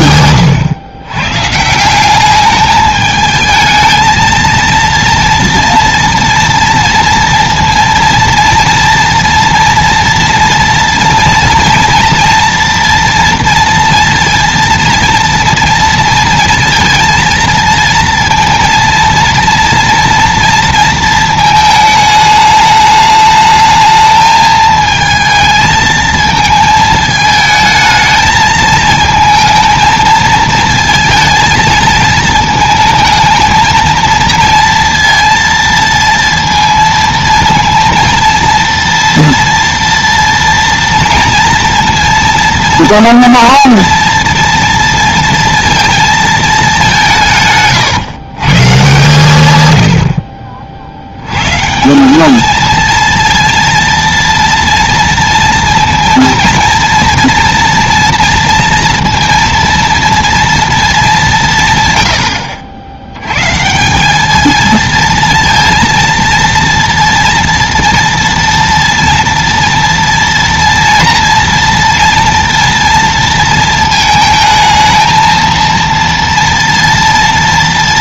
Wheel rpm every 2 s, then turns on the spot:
120, 210, 230, 230, 230, 230, 230, 230, 230, 230, 230, 210, 220, 220, 220, 230, 230, 230, 230, 230, 230, 230, 230, 200, 140, 60, 230, 230, 230, 230, 230, 90, 220, 230, 230, 230, 240, 220, 230.
none